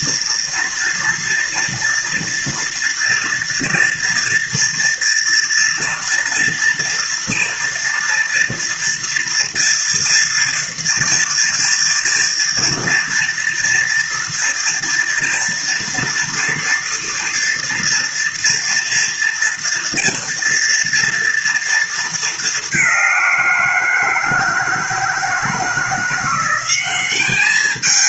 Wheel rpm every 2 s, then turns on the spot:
230, 230, 230, 230, 230, 230, 230, 230, 230, 230, 230, 210, 160, 180.
none